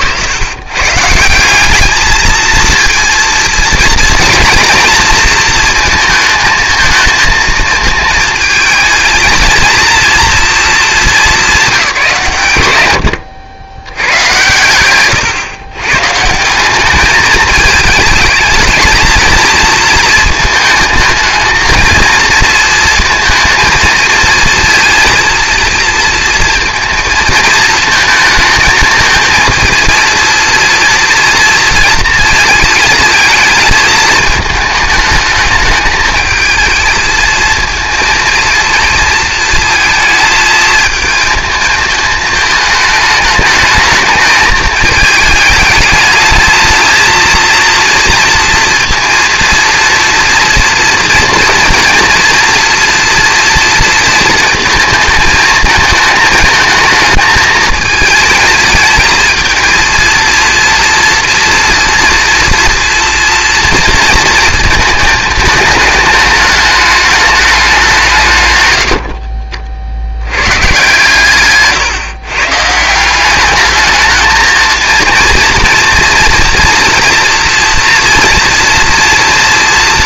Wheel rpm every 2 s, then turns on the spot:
140, 230, 230, 220, 220, 210, 120, 110, 190, 210, 220, 220, 230, 230, 220, 230, 220, 210, 220, 230, 220, 220, 220, 220, 230, 230, 230, 220, 220, 220, 230, 230, 230, 210, 100, 130, 150, 220, 230, 240.
none